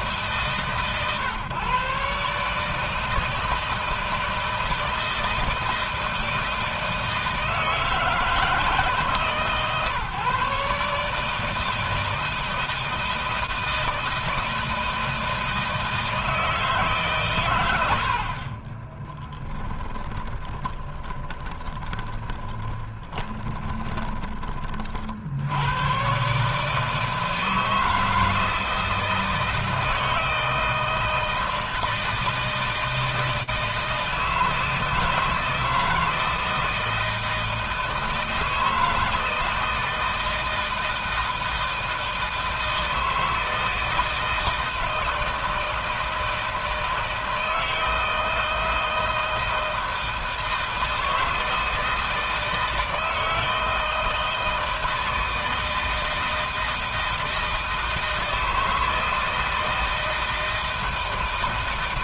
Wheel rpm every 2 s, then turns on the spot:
140, 150, 160, 160, 160, 150, 160, 160, 150, 30, 20, 20, 40, 150, 160, 160, 160, 160, 160, 160, 160, 160, 160, 160, 160, 160, 160, 160, 160, 160, 160.
18-24